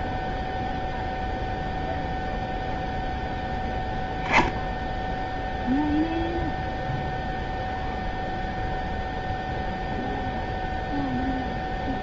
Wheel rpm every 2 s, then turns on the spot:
0, 0, 0, 0, 0, 0.
none